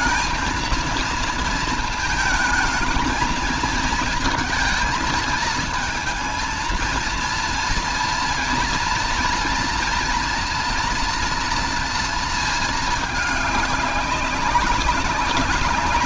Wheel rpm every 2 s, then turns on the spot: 220, 220, 220, 230, 230, 230, 230, 200.
none